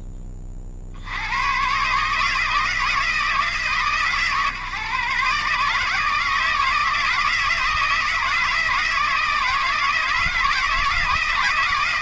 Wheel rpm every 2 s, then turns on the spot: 50, 160, 130, 160, 160, 160.
none